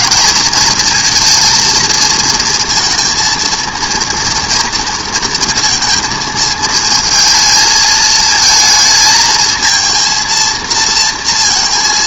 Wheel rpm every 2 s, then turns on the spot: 230, 230, 230, 220, 220, 230.
none